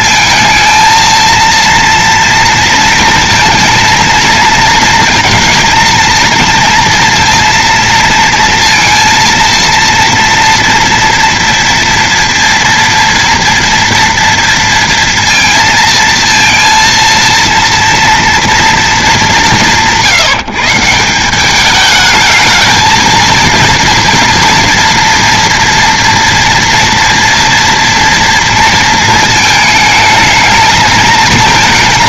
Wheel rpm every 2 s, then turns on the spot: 230, 230, 230, 230, 230, 230, 230, 230, 230, 230, 160, 220, 230, 230, 230, 220.
none